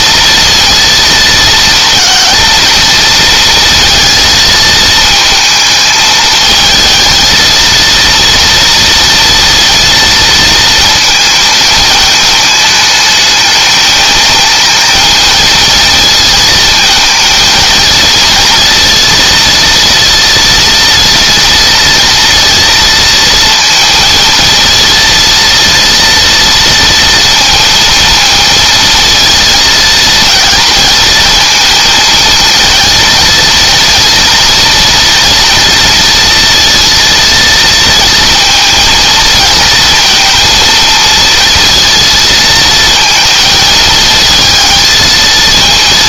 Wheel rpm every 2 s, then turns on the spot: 230, 230, 220, 220, 230, 230, 210, 220, 220, 230, 230, 230, 230, 230, 230, 220, 230, 230, 230, 230, 230, 230, 220.
none